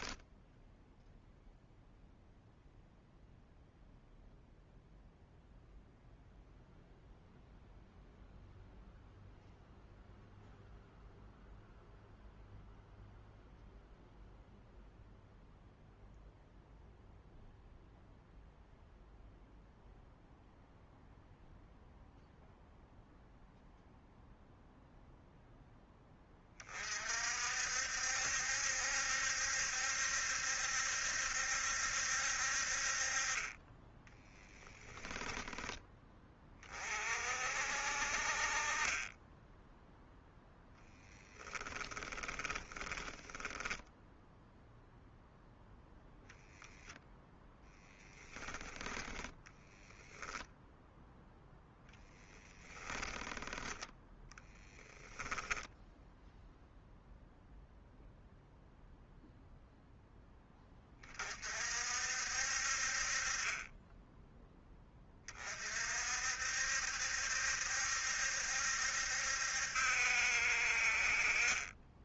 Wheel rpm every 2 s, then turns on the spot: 0, 0, 0, 0, 0, 0, 0, 0, 0, 0, 0, 0, 0, 40, 70, 70, 50, 10, 40, 30, 10, 20, 0, 10, 10, 0, 20, 10, 0, 0, 20, 50, 20, 70, 70, 50.
34-36 40-44 52-54